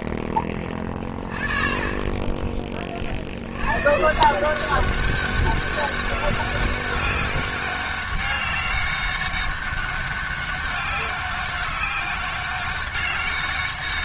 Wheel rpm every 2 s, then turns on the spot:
10, 10, 160, 200, 200, 200, 200.
none